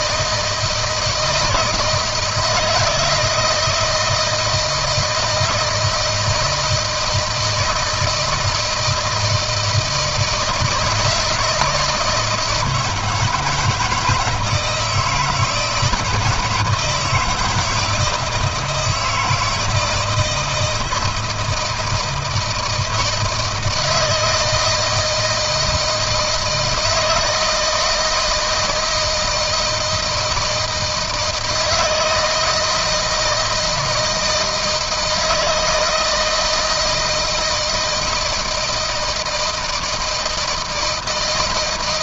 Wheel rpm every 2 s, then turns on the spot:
160, 170, 160, 160, 160, 170, 160, 160, 160, 160, 160, 160, 160, 160, 160, 160, 160, 160, 160, 160, 170.
none